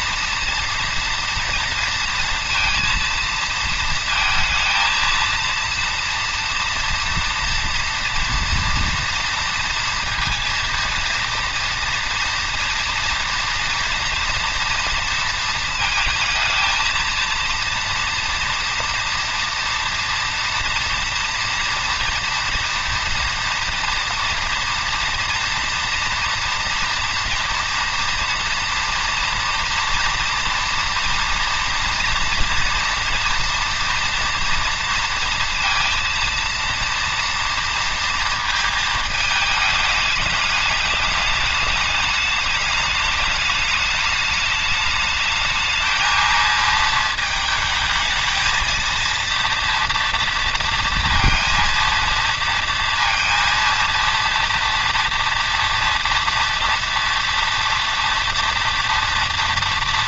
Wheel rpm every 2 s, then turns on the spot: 230, 230, 230, 230, 230, 230, 230, 230, 220, 230, 230, 230, 230, 230, 230, 230, 230, 230, 230, 220, 210, 210, 210, 220, 220, 230, 230, 230, 230, 240.
none